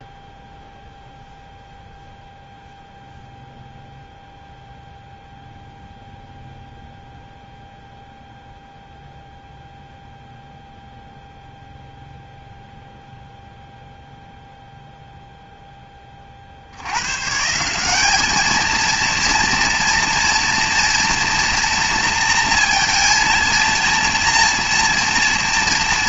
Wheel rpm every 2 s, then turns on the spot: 0, 0, 0, 0, 0, 0, 0, 0, 90, 230, 230, 230, 230.
none